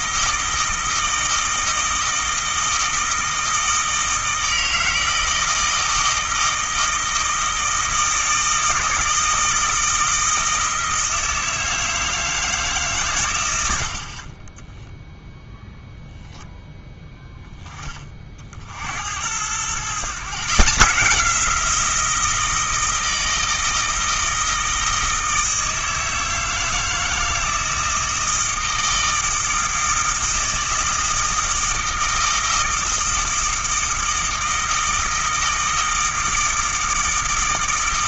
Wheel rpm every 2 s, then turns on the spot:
160, 160, 160, 160, 160, 160, 130, 0, 10, 80, 170, 160, 160, 160, 160, 160, 160, 160, 160.
none